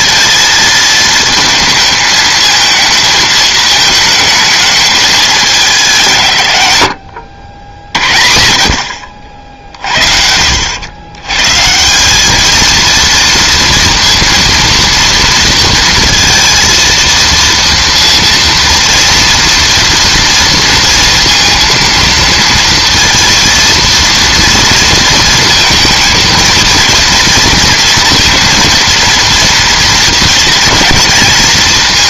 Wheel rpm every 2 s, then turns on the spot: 220, 220, 220, 100, 70, 80, 220, 230, 230, 230, 230, 230, 230, 230, 230, 230.
none